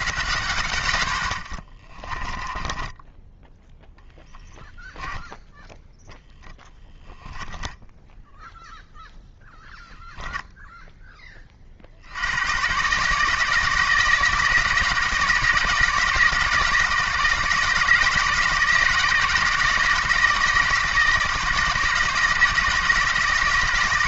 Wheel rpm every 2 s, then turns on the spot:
80, 20, 20, 20, 0, 0, 120, 170, 160, 160, 160, 160.
2-4 6-8